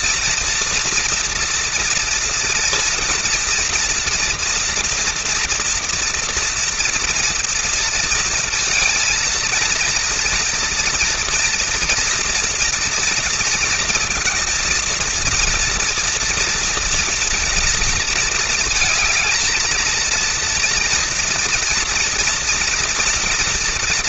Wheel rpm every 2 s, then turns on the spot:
230, 230, 230, 230, 230, 230, 240, 230, 230, 220, 230, 230.
none